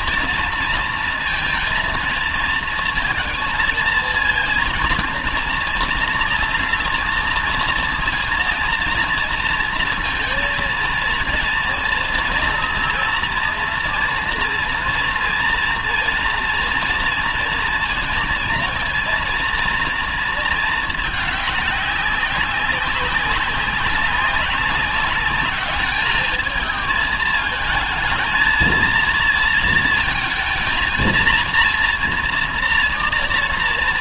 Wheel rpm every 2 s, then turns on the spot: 230, 230, 230, 230, 230, 230, 230, 230, 230, 230, 220, 200, 190, 210, 230, 220, 230.
none